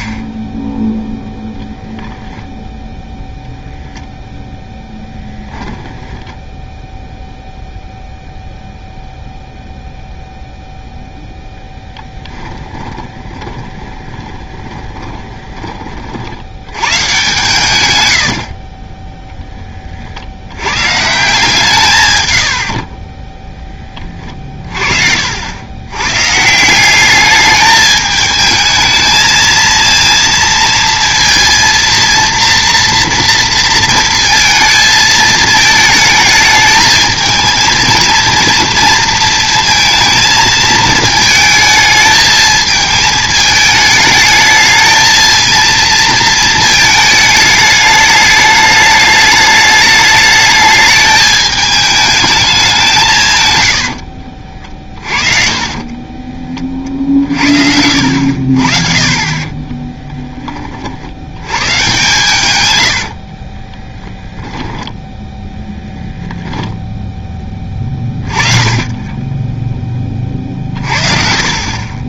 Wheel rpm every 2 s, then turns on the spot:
0, 0, 10, 10, 0, 0, 20, 20, 110, 30, 110, 50, 40, 180, 220, 230, 230, 220, 210, 230, 220, 220, 220, 220, 210, 210, 190, 40, 40, 50, 30, 100, 10, 10, 30, 40.
4-6 12-16 22-26 54-56 64-66